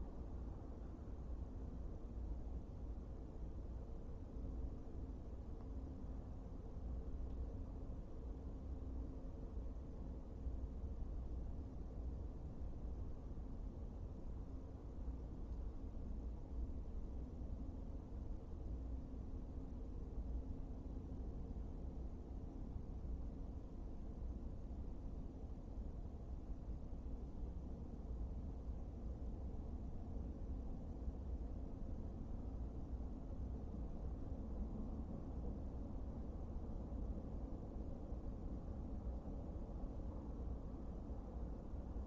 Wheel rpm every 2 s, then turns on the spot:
0, 0, 0, 0, 0, 0, 0, 0, 0, 0, 0, 0, 0, 0, 0, 0, 0, 0, 0, 0, 0.
none